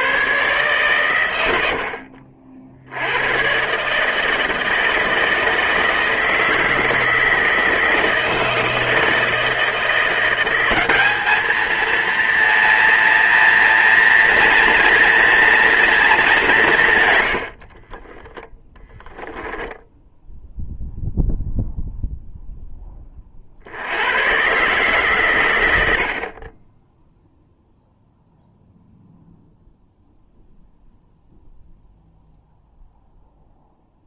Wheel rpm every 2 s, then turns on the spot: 130, 70, 160, 160, 160, 190, 230, 230, 170, 10, 0, 10, 130, 20, 0, 0, 0.
none